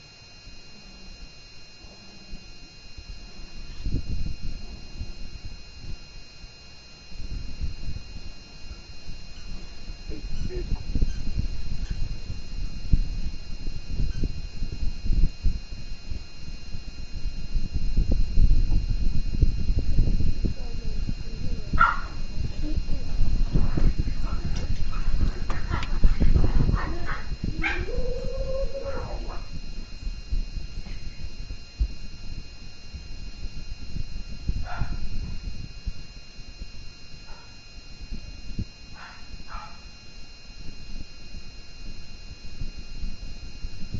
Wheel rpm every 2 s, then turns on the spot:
0, 0, 0, 0, 0, 0, 0, 0, 0, 0, 0, 0, 0, 0, 0, 0, 0, 0, 0, 0, 0, 0.
none